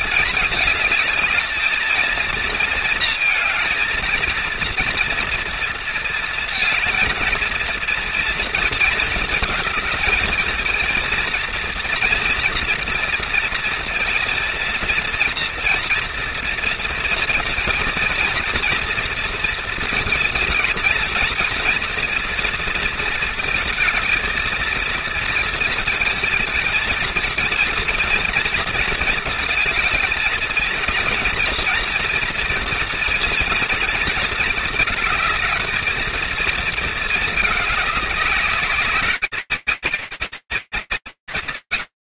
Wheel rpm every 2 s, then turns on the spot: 220, 230, 230, 230, 230, 230, 230, 230, 230, 230, 220, 230, 230, 230, 230, 230, 230, 220, 230, 200, 140.
none